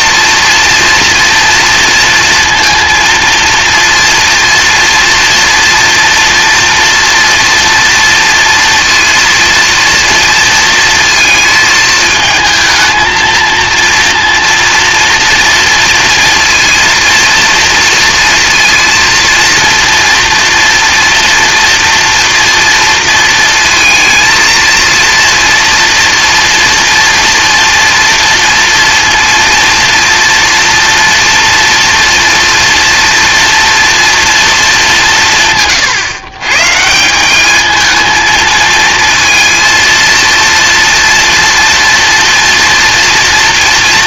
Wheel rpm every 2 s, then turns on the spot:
240, 230, 230, 230, 230, 230, 220, 230, 240, 230, 230, 230, 230, 230, 230, 240, 230, 220, 140, 220, 240, 240.
none